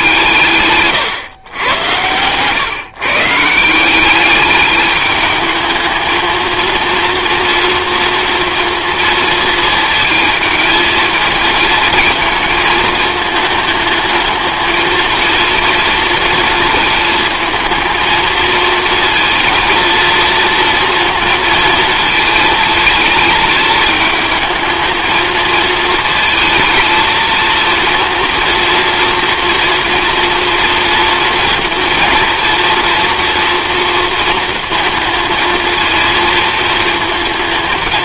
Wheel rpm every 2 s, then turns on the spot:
130, 130, 210, 230, 230, 220, 220, 220, 220, 230, 230, 220, 220, 230, 230, 240, 230, 220, 230.
none